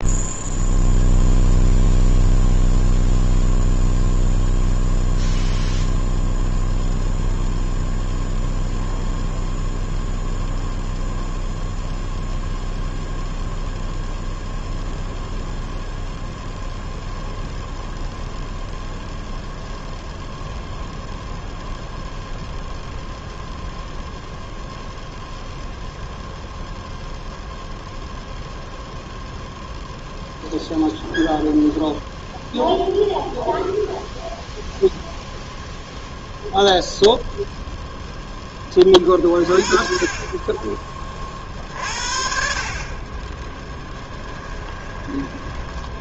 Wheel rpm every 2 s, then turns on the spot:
0, 0, 0, 0, 0, 0, 0, 0, 0, 0, 0, 0, 0, 0, 0, 0, 0, 0, 0, 30, 30, 40, 10.
40-42 44-46